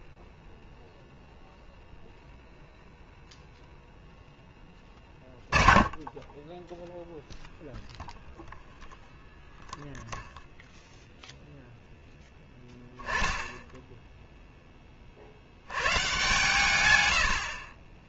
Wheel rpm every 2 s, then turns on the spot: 10, 0, 10, 10, 0, 0, 10, 60, 60.
0-2